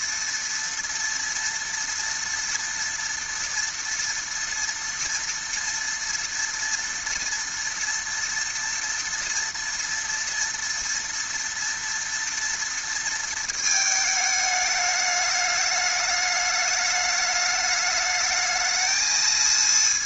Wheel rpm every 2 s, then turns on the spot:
230, 240, 240, 230, 230, 230, 230, 210, 210, 220.
none